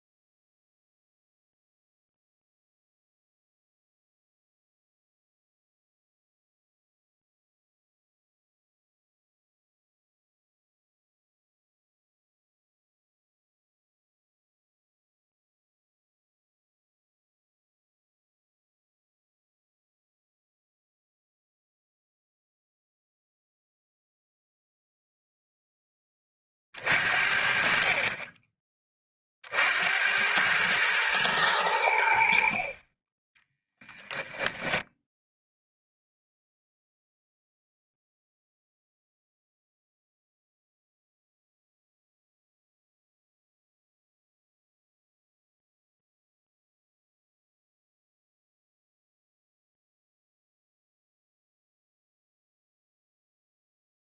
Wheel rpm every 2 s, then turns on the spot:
0, 0, 0, 0, 0, 0, 0, 0, 0, 0, 0, 0, 0, 40, 20, 110, 40, 0, 0, 0, 0, 0, 0, 0, 0, 0, 0.
none